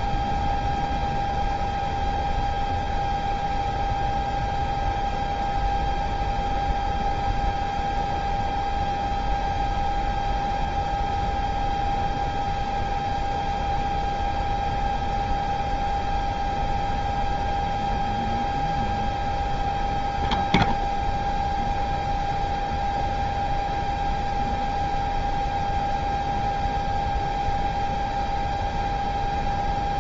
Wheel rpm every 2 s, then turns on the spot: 0, 0, 0, 0, 0, 0, 0, 0, 0, 0, 0, 0, 0, 0, 0.
none